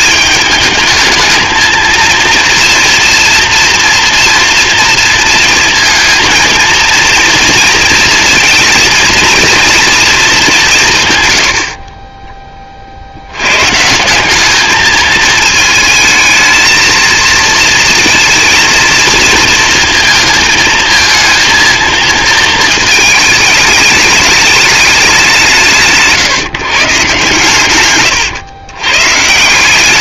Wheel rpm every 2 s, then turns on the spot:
210, 230, 240, 230, 230, 180, 30, 210, 220, 230, 230, 220, 210, 160, 130.
none